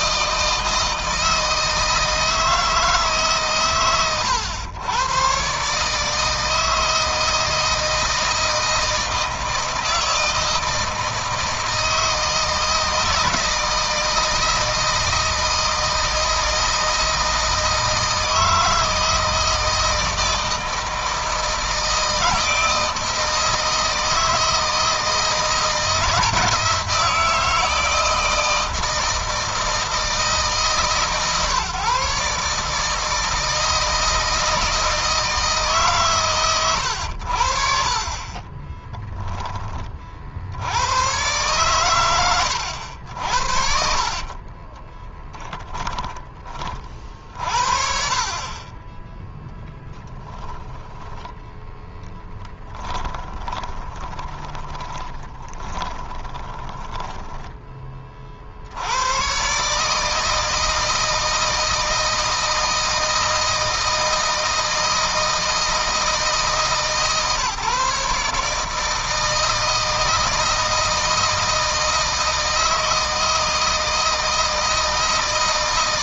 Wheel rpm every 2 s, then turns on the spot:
160, 160, 110, 160, 160, 160, 160, 160, 160, 160, 160, 160, 160, 160, 160, 160, 150, 160, 100, 20, 90, 80, 20, 40, 30, 10, 10, 20, 10, 80, 160, 160, 160, 150, 150, 160, 160, 160.
38-40 44-46 52-58